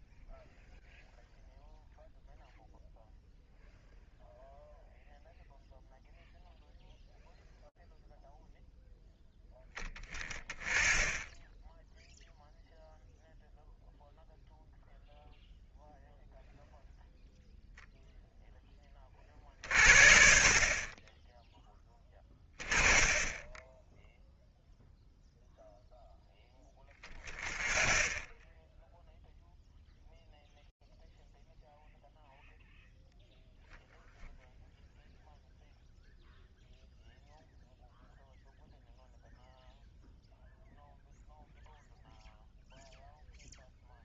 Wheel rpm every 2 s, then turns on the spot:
0, 0, 0, 0, 0, 10, 0, 0, 0, 20, 20, 20, 0, 10, 10, 0, 0, 0, 0, 0, 0, 0.
none